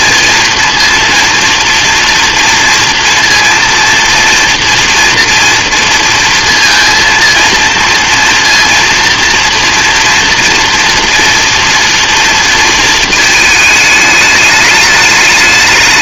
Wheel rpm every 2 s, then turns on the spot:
230, 230, 240, 230, 230, 240, 230, 210.
none